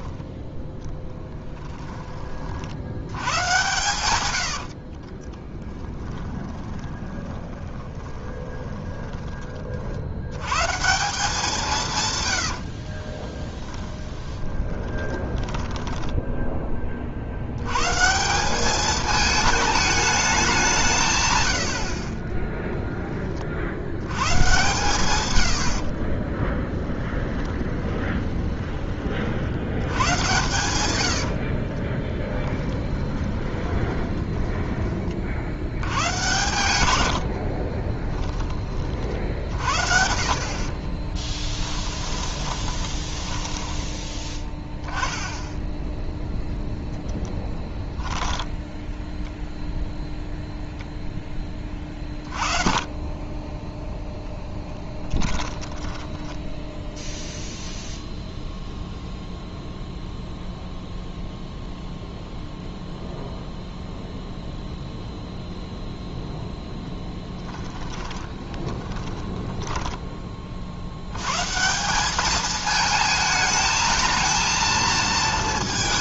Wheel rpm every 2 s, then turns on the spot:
10, 70, 70, 20, 20, 160, 70, 20, 10, 200, 180, 10, 130, 20, 20, 100, 20, 20, 110, 30, 40, 20, 10, 0, 10, 0, 30, 10, 0, 0, 0, 0, 0, 10, 10, 60, 210, 230.
4-10 12-16 22-24 26-28 32-34 36-38 40-44 48-50 54-56 66-70